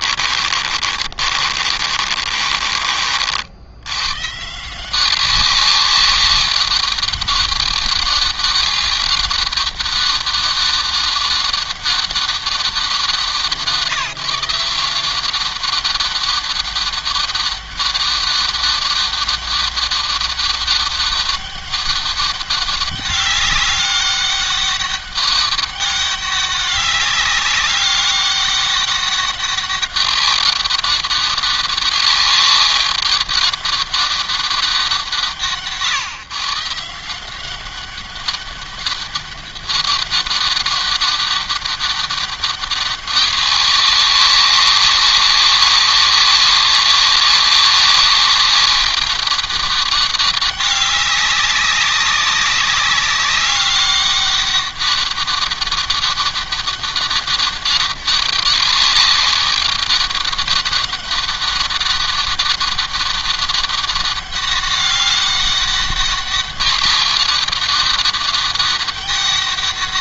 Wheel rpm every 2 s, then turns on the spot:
40, 50, 180, 200, 200, 200, 190, 180, 200, 200, 200, 200, 200, 190, 200, 200, 200, 170, 170, 200, 200, 200, 190, 200, 200, 200, 200, 200, 200, 200, 200, 200, 200, 200, 200.
0-2